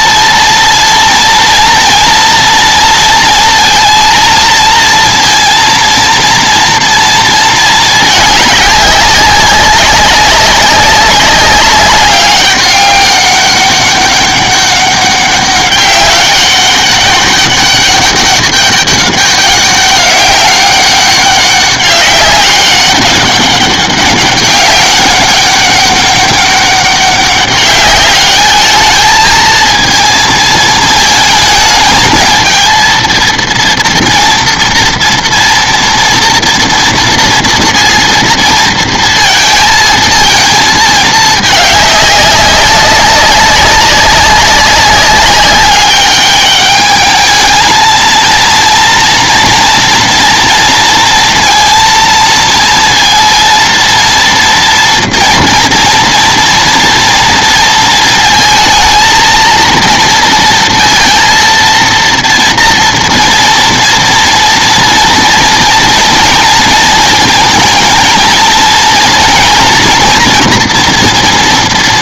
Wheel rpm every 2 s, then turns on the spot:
230, 230, 230, 230, 200, 190, 200, 200, 200, 200, 200, 200, 200, 200, 210, 220, 220, 230, 230, 230, 220, 200, 190, 210, 230, 230, 230, 240, 230, 220, 230, 230, 230, 230, 230, 230.
none